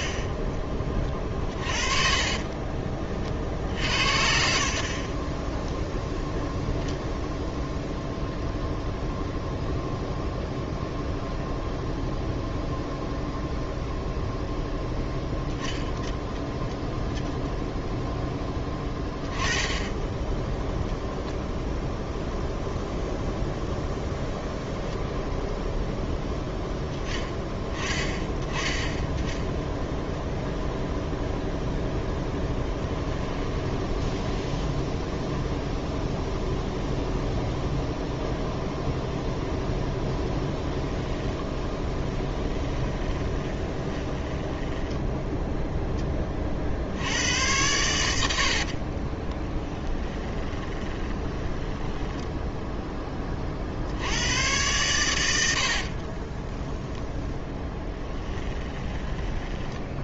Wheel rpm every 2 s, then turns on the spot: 20, 30, 50, 0, 0, 0, 0, 0, 0, 10, 0, 0, 10, 10, 10, 0, 10, 0, 0, 0, 10, 20, 10, 60, 50, 20, 10, 100, 10, 20.
0-6 32-34 40-46 48-52 58-60